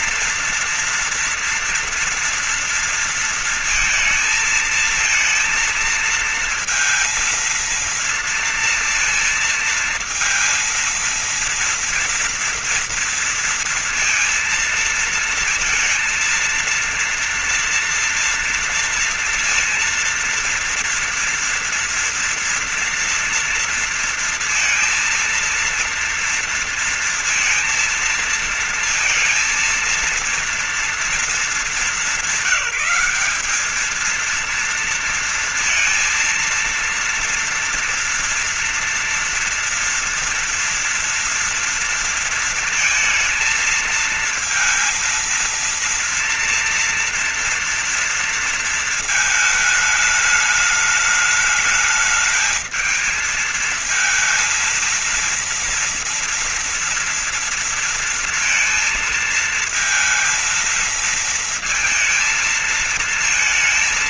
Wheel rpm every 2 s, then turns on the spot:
240, 240, 230, 230, 230, 230, 230, 230, 230, 230, 230, 230, 230, 230, 230, 230, 200, 220, 230, 230, 240, 230, 220, 230, 230, 210, 220, 230, 230, 230, 230, 230.
none